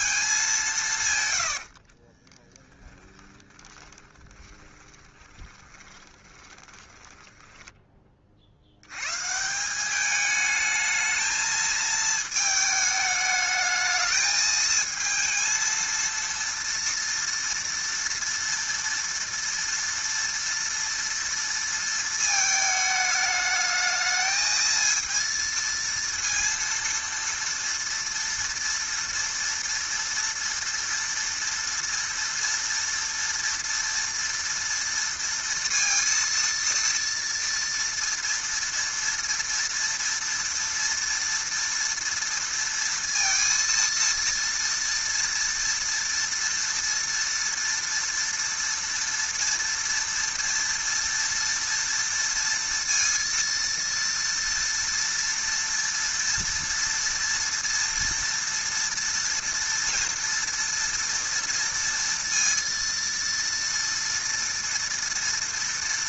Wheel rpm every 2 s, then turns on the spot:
190, 10, 20, 20, 80, 220, 220, 220, 230, 230, 230, 220, 220, 230, 230, 230, 230, 230, 230, 230, 230, 230, 230, 230, 230, 230, 230, 230, 230, 230, 230, 230, 230.
2-8